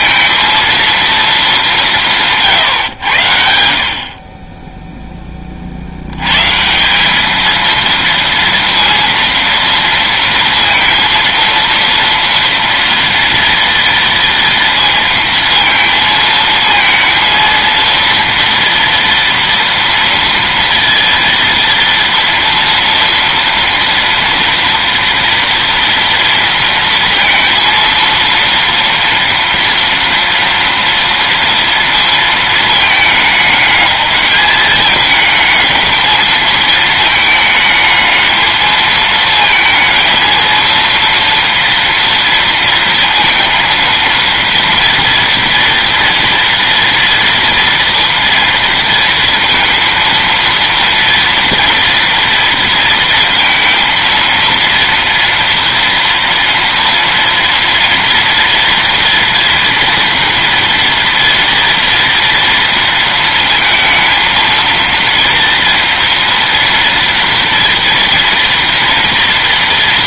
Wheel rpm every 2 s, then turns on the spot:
230, 140, 10, 160, 230, 230, 230, 230, 230, 230, 230, 230, 230, 230, 230, 230, 220, 220, 220, 220, 230, 230, 230, 230, 230, 230, 230, 230, 230, 230, 230, 230, 230, 230, 230.
none